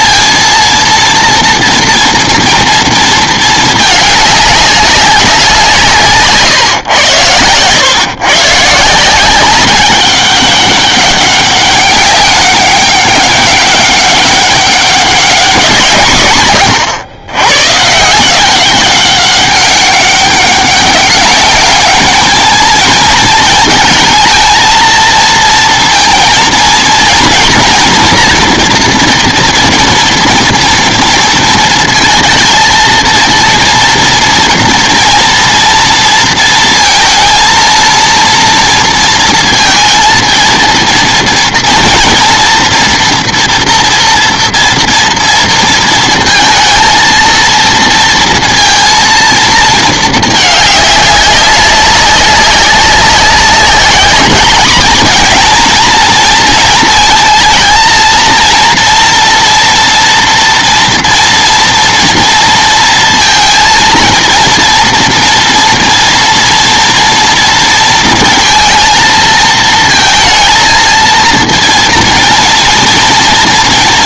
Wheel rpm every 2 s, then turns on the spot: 230, 230, 200, 120, 150, 200, 200, 200, 120, 200, 200, 230, 230, 230, 230, 230, 230, 230, 230, 230, 230, 230, 230, 230, 230, 200, 190, 220, 230, 230, 240, 230, 240, 230, 230, 230, 230.
none